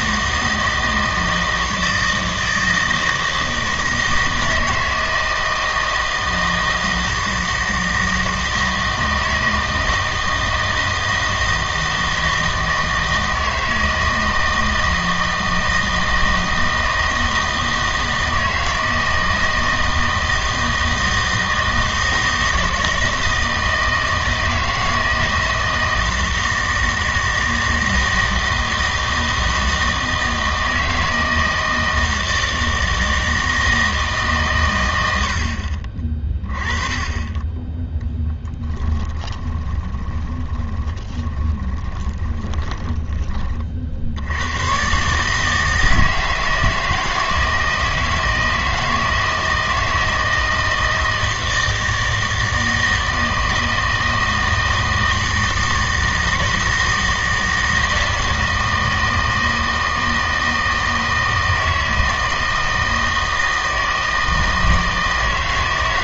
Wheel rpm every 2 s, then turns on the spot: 160, 160, 160, 160, 160, 160, 160, 160, 160, 160, 160, 160, 160, 160, 160, 160, 160, 110, 20, 10, 20, 10, 110, 160, 160, 160, 160, 160, 160, 160, 160, 160, 160.
38-44